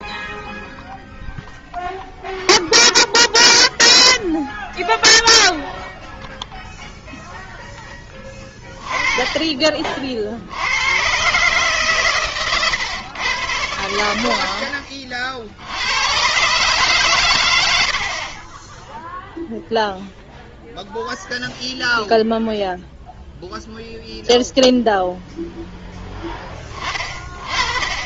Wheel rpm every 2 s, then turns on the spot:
0, 0, 0, 0, 20, 80, 120, 50, 140, 0, 0, 0, 0, 20.
none